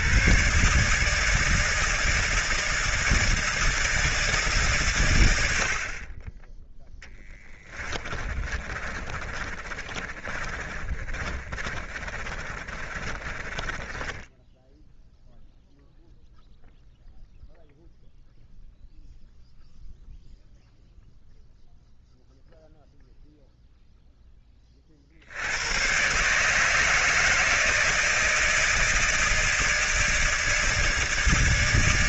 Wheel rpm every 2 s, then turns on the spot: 140, 160, 150, 20, 30, 30, 30, 10, 0, 0, 0, 0, 10, 140, 160, 160.
8-16